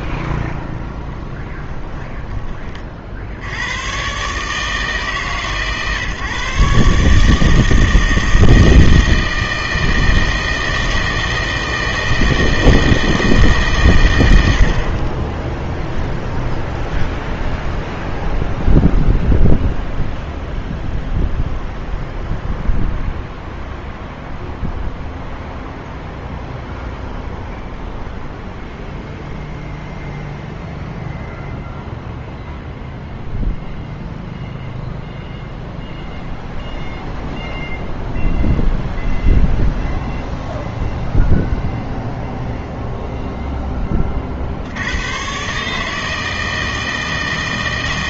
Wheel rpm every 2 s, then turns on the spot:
20, 30, 150, 140, 160, 160, 160, 70, 0, 0, 0, 0, 0, 0, 0, 0, 0, 0, 0, 0, 0, 0, 80, 160.
0-2